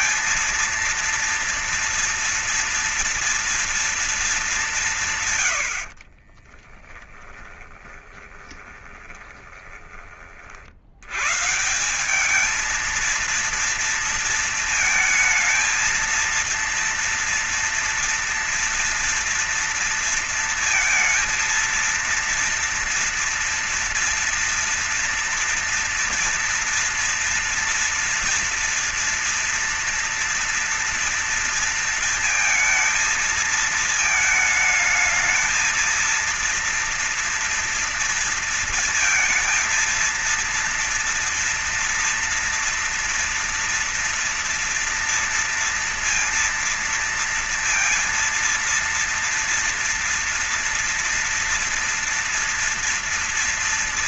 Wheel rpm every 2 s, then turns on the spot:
230, 230, 180, 30, 20, 60, 220, 230, 230, 230, 230, 230, 240, 240, 230, 230, 230, 220, 230, 230, 230, 230, 240, 230, 230, 230, 230.
6-10